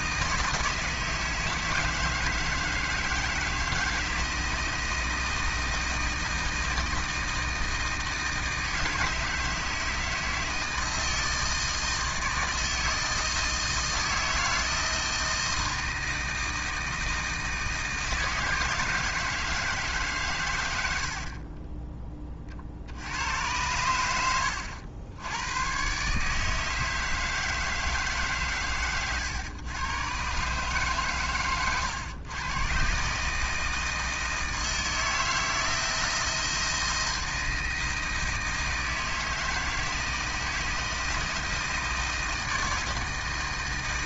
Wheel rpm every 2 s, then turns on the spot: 160, 160, 160, 160, 160, 160, 160, 160, 160, 160, 80, 70, 90, 160, 120, 130, 140, 160, 170, 160, 160, 160.
20-22